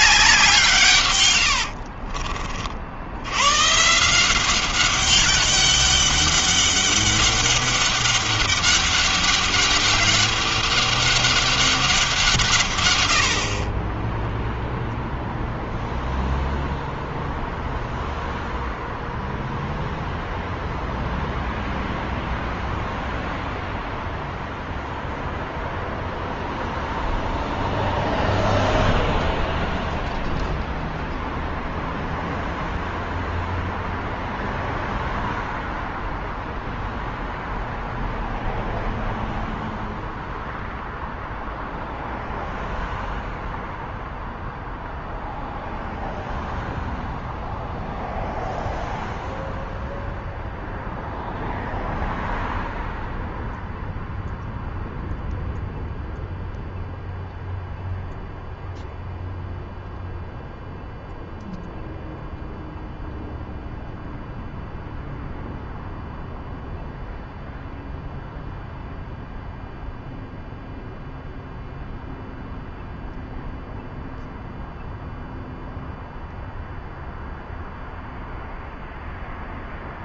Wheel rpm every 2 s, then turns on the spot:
130, 80, 200, 200, 200, 200, 90, 0, 0, 0, 0, 0, 0, 0, 0, 0, 0, 0, 0, 0, 0, 0, 0, 0, 0, 0, 0, 0, 0, 0, 0, 0, 0, 0, 0, 0, 0, 0, 0, 0.
none